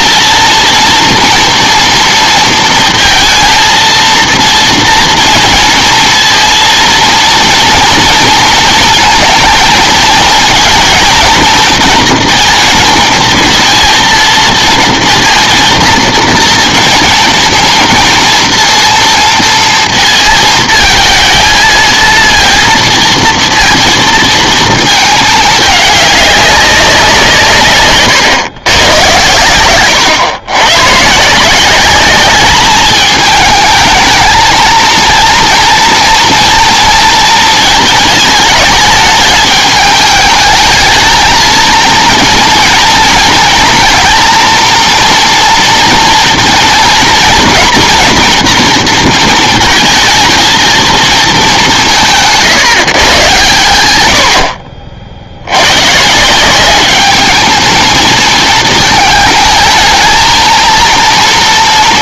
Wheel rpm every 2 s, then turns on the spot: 230, 230, 230, 230, 220, 230, 230, 230, 230, 230, 220, 230, 220, 190, 120, 110, 210, 230, 230, 210, 220, 230, 230, 230, 230, 230, 150, 50, 190, 220, 230.
none